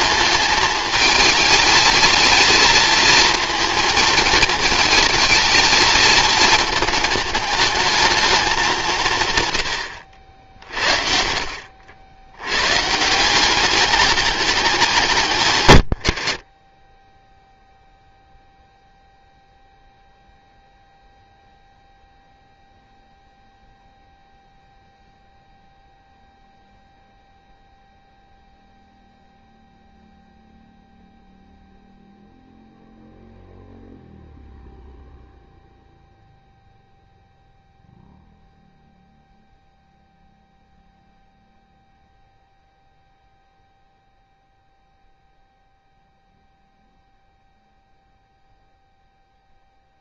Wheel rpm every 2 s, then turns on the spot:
210, 230, 230, 220, 160, 60, 160, 170, 20, 0, 0, 0, 0, 0, 0, 0, 0, 0, 0, 0, 0, 0, 0, 0, 0.
none